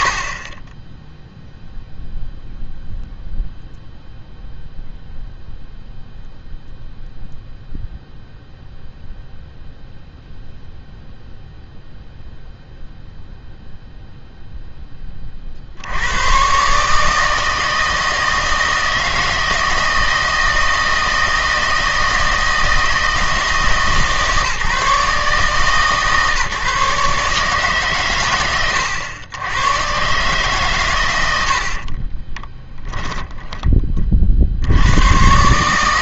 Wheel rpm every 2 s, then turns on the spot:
10, 0, 0, 0, 0, 0, 0, 10, 140, 160, 160, 160, 150, 140, 100, 120, 10, 80.
32-34